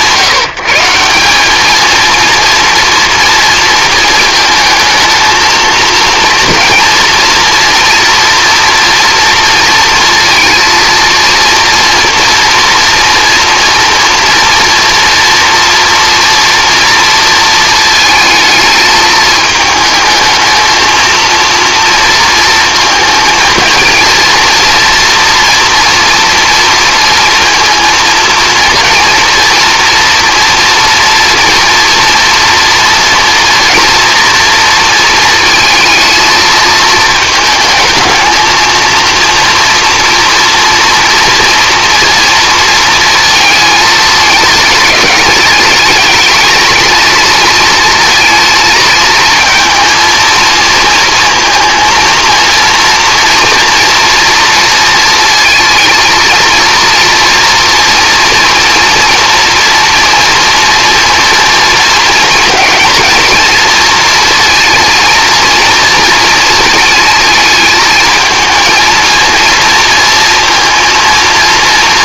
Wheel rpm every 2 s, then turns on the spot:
150, 230, 220, 230, 230, 230, 240, 230, 230, 220, 220, 230, 230, 230, 230, 230, 230, 230, 220, 230, 230, 230, 200, 230, 230, 230, 230, 230, 230, 230, 230, 220, 230, 220, 220, 230.
none